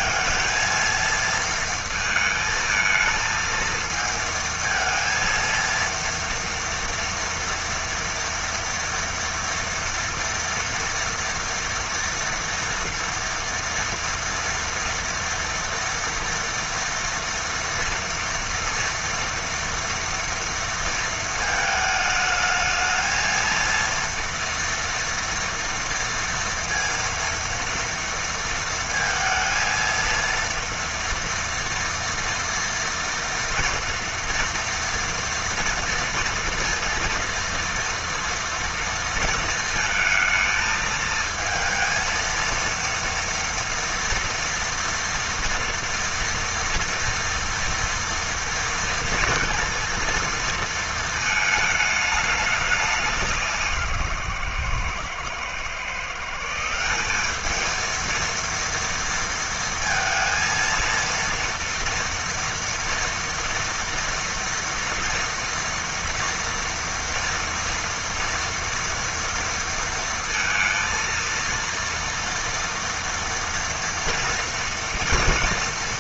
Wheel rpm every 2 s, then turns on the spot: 220, 220, 230, 230, 230, 230, 230, 230, 230, 230, 230, 220, 230, 230, 230, 230, 240, 230, 230, 230, 220, 230, 240, 230, 230, 230, 200, 120, 170, 230, 230, 240, 230, 230, 230, 230, 230, 230.
none